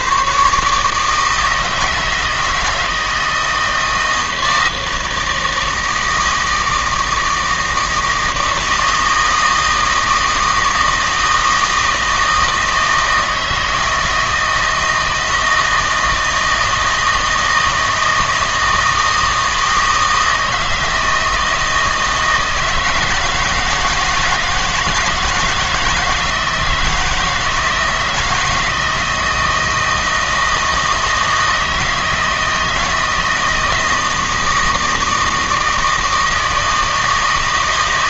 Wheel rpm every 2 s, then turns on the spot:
140, 160, 160, 160, 160, 160, 160, 160, 160, 160, 160, 160, 160, 160, 160, 160, 160, 160, 160.
none